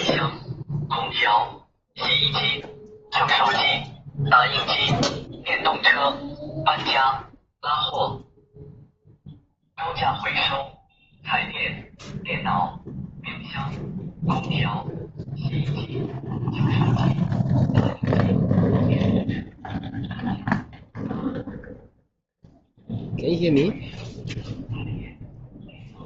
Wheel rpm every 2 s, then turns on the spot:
0, 0, 0, 0, 0, 0, 0, 0, 0, 0, 0, 0, 0.
none